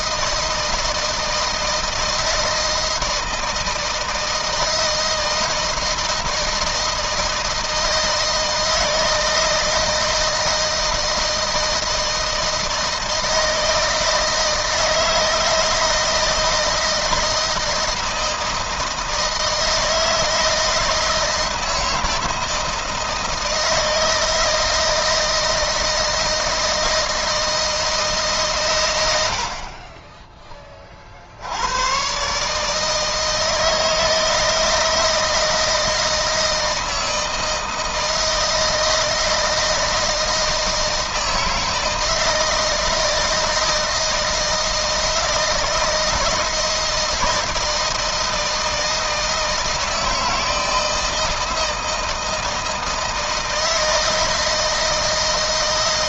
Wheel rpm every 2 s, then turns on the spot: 160, 160, 160, 160, 160, 160, 160, 160, 160, 160, 160, 160, 160, 170, 80, 50, 160, 160, 160, 160, 160, 160, 160, 160, 160, 160, 160, 170.
none